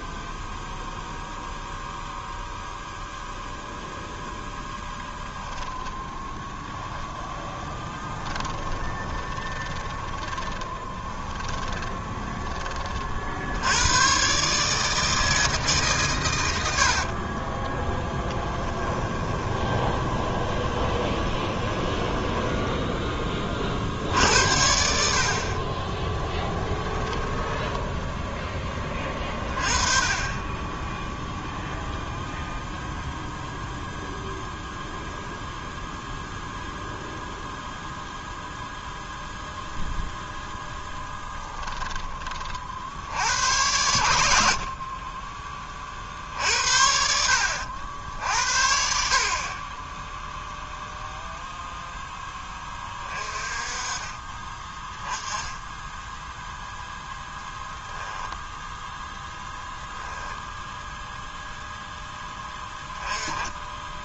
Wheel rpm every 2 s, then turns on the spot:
0, 0, 10, 10, 20, 20, 20, 150, 80, 10, 20, 10, 70, 10, 20, 10, 0, 0, 0, 0, 0, 50, 50, 60, 60, 0, 20, 10, 0, 0, 0, 10.
4-6 8-12 16-24 26-28